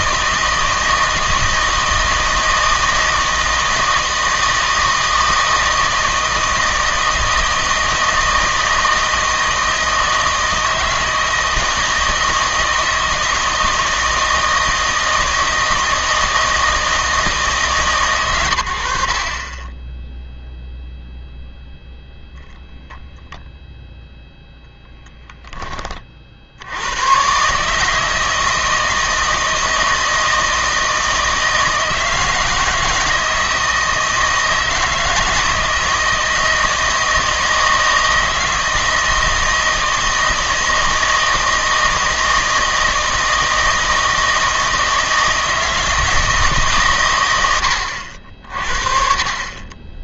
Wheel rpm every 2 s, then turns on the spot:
160, 160, 160, 160, 160, 160, 160, 160, 160, 90, 0, 0, 0, 70, 160, 160, 160, 160, 160, 160, 160, 160, 160, 150, 50.
none